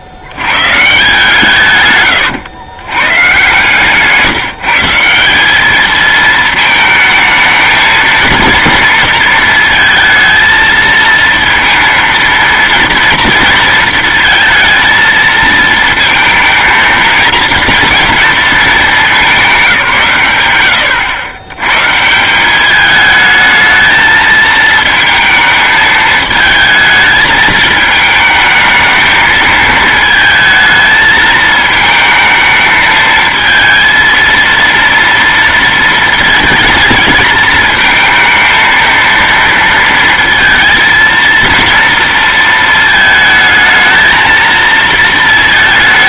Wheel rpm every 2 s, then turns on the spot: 90, 120, 160, 220, 230, 230, 230, 230, 220, 220, 110, 190, 220, 220, 220, 220, 220, 230, 230, 230, 230, 230, 230.
none